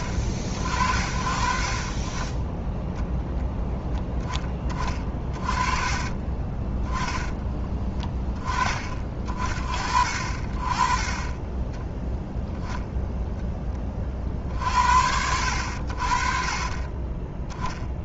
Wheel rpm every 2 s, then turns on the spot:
60, 10, 20, 20, 30, 40, 0, 60, 30.
4-6 16-18